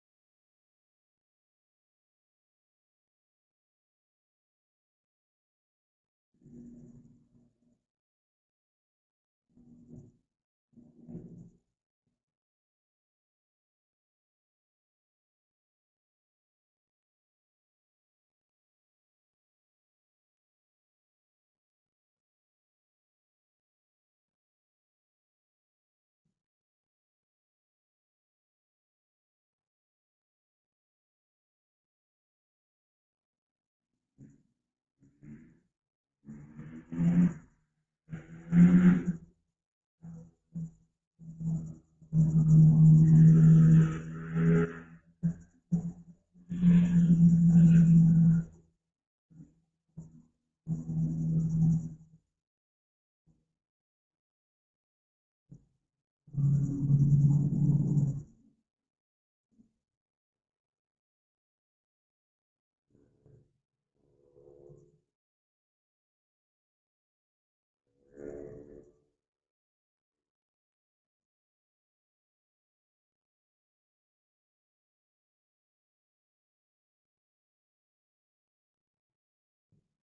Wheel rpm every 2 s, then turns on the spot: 0, 0, 0, 0, 0, 0, 0, 0, 0, 0, 0, 0, 0, 0, 0, 0, 0, 0, 0, 0, 0, 0, 0, 0, 0, 0, 0, 0, 0, 0, 0, 0, 0, 0, 0, 0, 0, 0, 0, 0.
none